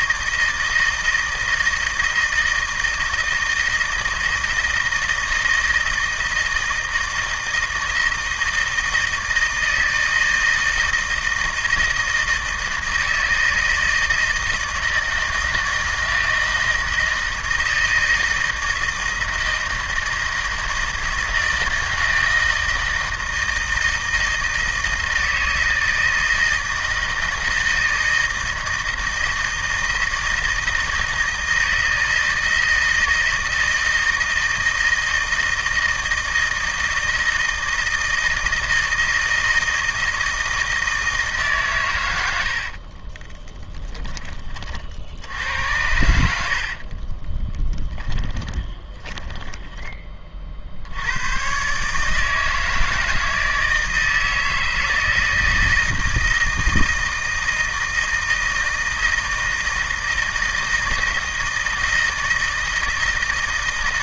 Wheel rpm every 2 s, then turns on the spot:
160, 160, 160, 160, 160, 160, 160, 160, 160, 160, 160, 160, 160, 160, 160, 160, 160, 160, 160, 160, 160, 50, 50, 50, 20, 60, 160, 160, 160, 160, 160, 160.
42-44 46-50